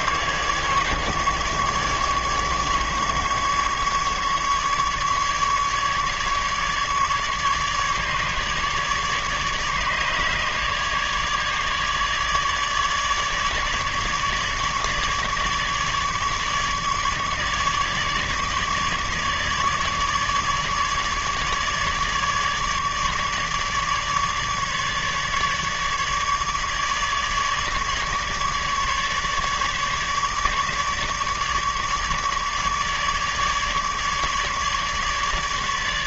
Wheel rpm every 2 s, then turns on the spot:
150, 150, 150, 150, 150, 150, 150, 150, 150, 150, 150, 150, 150, 150, 150, 150, 150, 150.
none